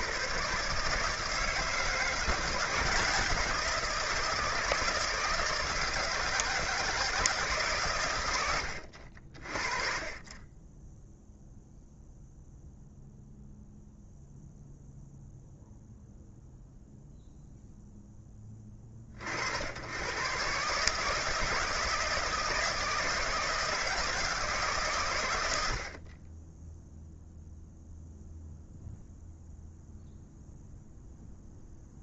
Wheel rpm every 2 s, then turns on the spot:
140, 170, 160, 160, 70, 10, 0, 0, 0, 40, 140, 160, 130, 0, 0, 0.
none